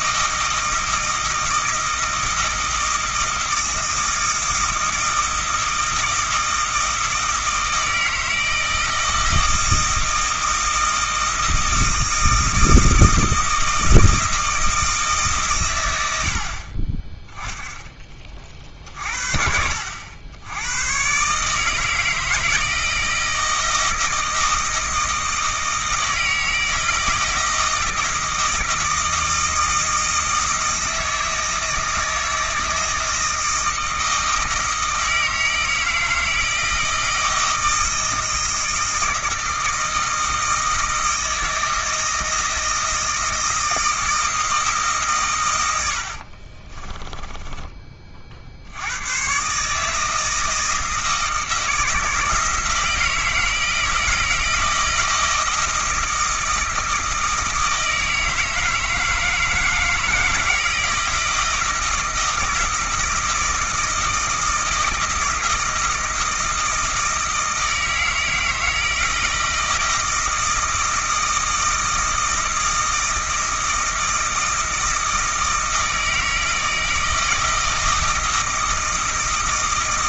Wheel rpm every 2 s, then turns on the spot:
160, 160, 160, 160, 160, 160, 160, 160, 40, 40, 100, 160, 160, 160, 160, 160, 160, 160, 160, 160, 160, 160, 160, 40, 70, 160, 160, 160, 160, 160, 160, 160, 160, 160, 160, 160, 160, 160, 160, 160.
46-48